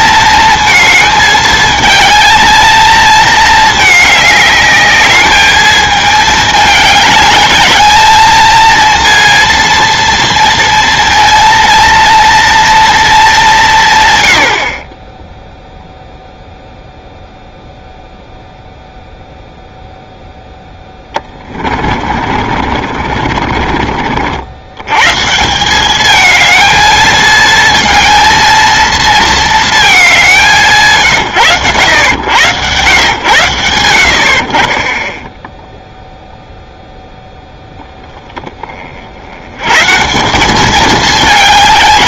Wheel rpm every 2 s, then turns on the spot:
230, 220, 210, 210, 230, 230, 230, 60, 0, 0, 10, 40, 100, 220, 230, 150, 100, 50, 0, 30, 200.
20-24